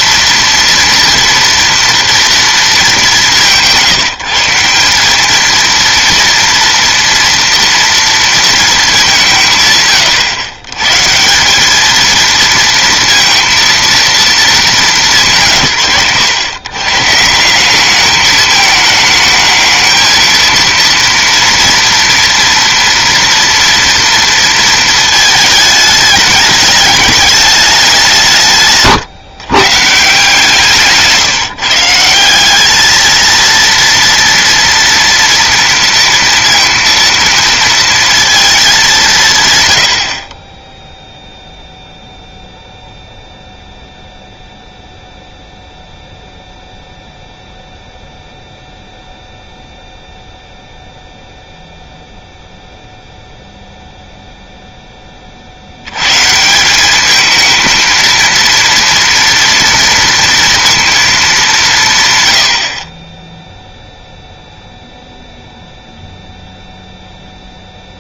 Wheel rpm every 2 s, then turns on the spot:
230, 200, 160, 230, 220, 120, 230, 230, 130, 220, 230, 230, 230, 210, 150, 150, 210, 230, 230, 220, 20, 0, 0, 0, 0, 0, 0, 0, 190, 230, 230, 60, 0, 0.
none